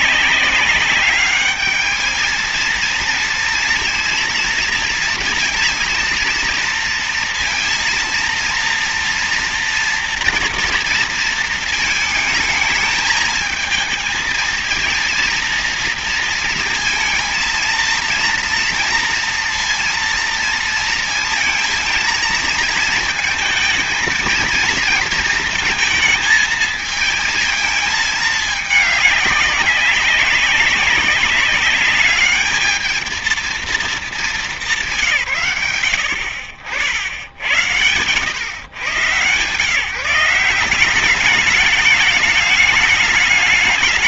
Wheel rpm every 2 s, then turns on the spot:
200, 230, 230, 230, 230, 230, 220, 230, 230, 230, 230, 230, 230, 220, 200, 200, 220, 180, 70, 130, 190, 210.
none